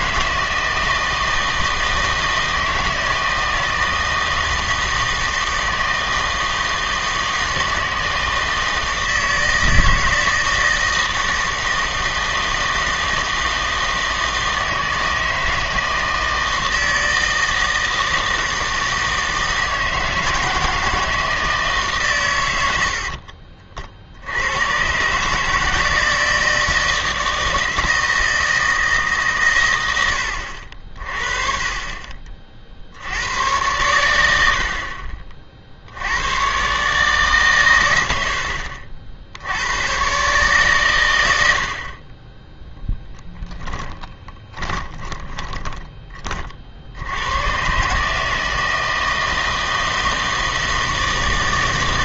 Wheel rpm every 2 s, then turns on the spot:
160, 160, 160, 160, 160, 160, 160, 160, 160, 160, 160, 90, 110, 160, 160, 60, 50, 70, 130, 60, 130, 10, 20, 50, 160, 160.
44-46